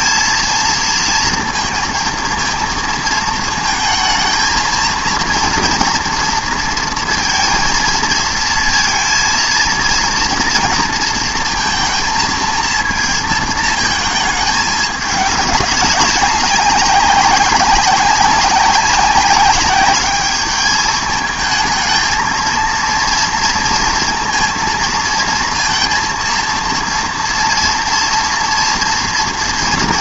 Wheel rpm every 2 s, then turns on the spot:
230, 230, 230, 230, 220, 230, 230, 210, 190, 200, 210, 230, 230, 230, 230.
none